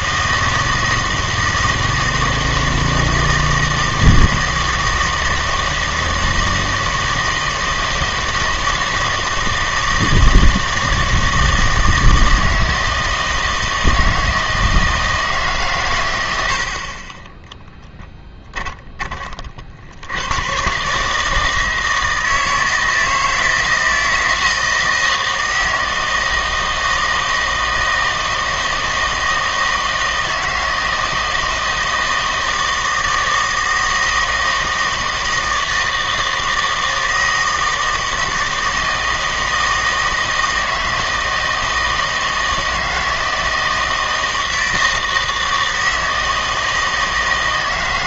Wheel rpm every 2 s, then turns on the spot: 160, 160, 160, 160, 160, 160, 160, 160, 60, 10, 130, 160, 160, 160, 160, 160, 160, 160, 160, 160, 160, 160, 160, 160.
18-20